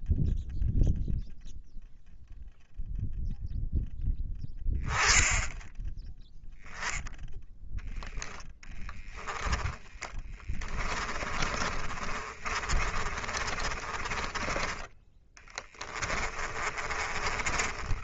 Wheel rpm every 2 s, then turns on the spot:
0, 0, 10, 0, 10, 20, 30, 20, 30.
8-14 16-18